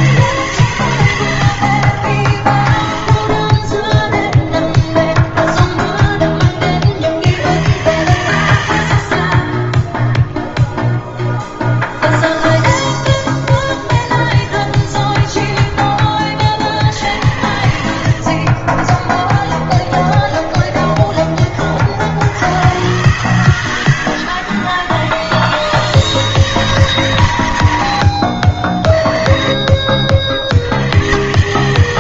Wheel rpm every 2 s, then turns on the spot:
130, 30, 10, 40, 80, 0, 0, 10, 70, 20, 20, 110, 40, 140, 40, 80.
4-6 14-16 18-22